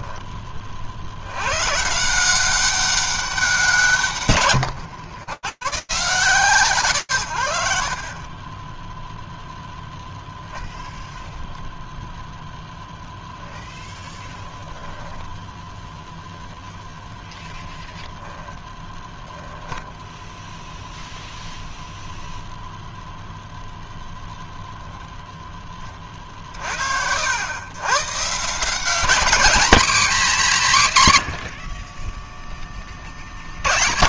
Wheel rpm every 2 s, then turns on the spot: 50, 190, 100, 110, 0, 0, 10, 10, 0, 10, 0, 0, 0, 90, 210, 100, 40.
18-20